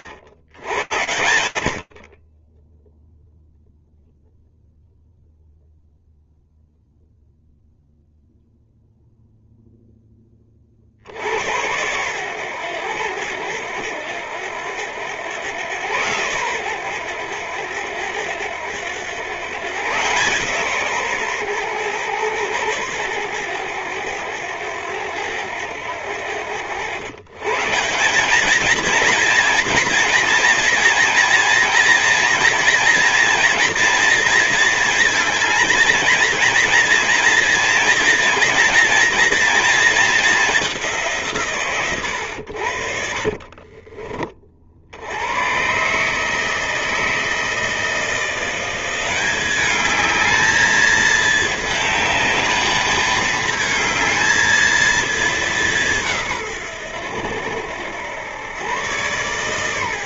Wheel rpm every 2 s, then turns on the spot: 90, 0, 0, 0, 10, 100, 90, 110, 90, 140, 110, 100, 90, 190, 230, 230, 230, 220, 240, 220, 110, 30, 130, 160, 210, 220, 220, 190, 90, 120.
42-44